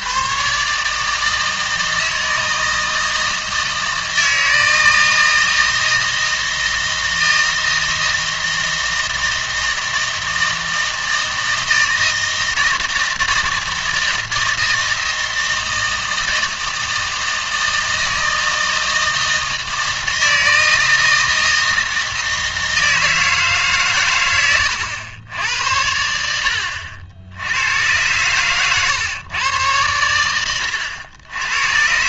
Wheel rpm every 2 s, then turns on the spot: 140, 160, 160, 160, 160, 160, 160, 160, 160, 160, 160, 160, 100, 70, 120, 100.
30-32